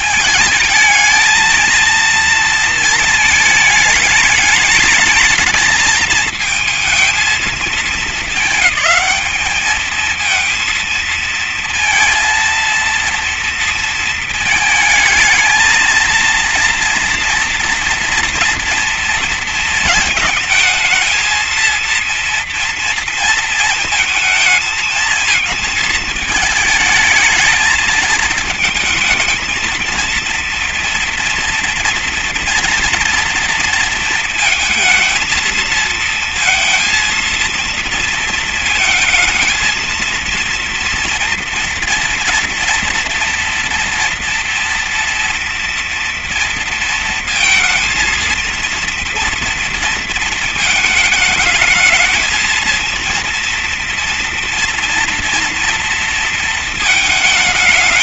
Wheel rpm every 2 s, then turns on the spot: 220, 220, 220, 230, 210, 230, 230, 230, 230, 230, 230, 230, 220, 220, 230, 230, 230, 230, 230, 230, 230, 230, 230, 230, 230, 220, 240, 240, 220.
none